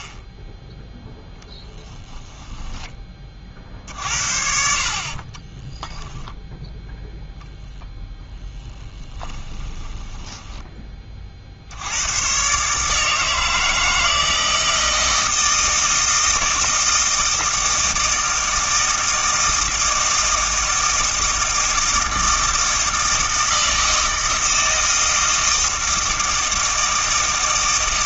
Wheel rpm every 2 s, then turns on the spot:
10, 10, 50, 0, 10, 10, 130, 160, 160, 160, 160, 160, 160, 160.
2-4 8-12